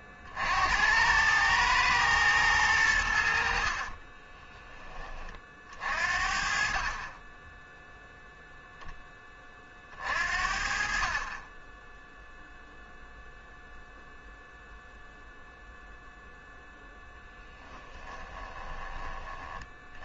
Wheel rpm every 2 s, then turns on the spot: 70, 100, 20, 40, 0, 50, 0, 0, 0, 20.
18-20